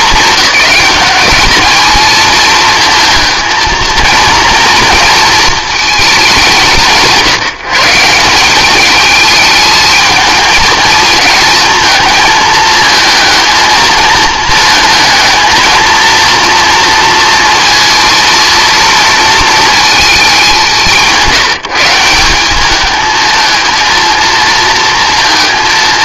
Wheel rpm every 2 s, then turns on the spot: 220, 220, 230, 190, 190, 220, 220, 220, 230, 230, 190, 200, 220.
none